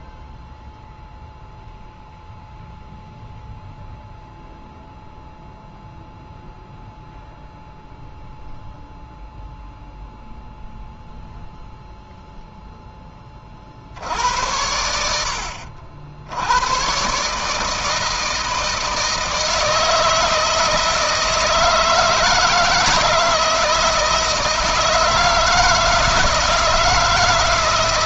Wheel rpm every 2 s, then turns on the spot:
0, 0, 0, 0, 0, 0, 0, 80, 90, 160, 160, 160, 160, 160.
none